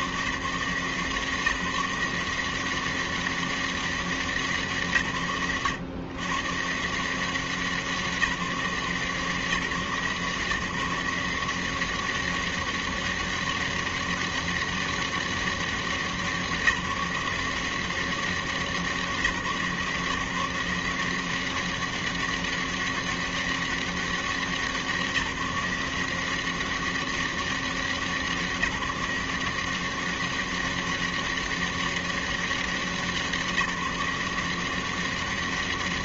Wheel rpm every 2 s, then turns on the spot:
110, 170, 200, 110, 180, 150, 190, 200, 190, 180, 160, 190, 190, 180, 170, 190, 200, 170.
none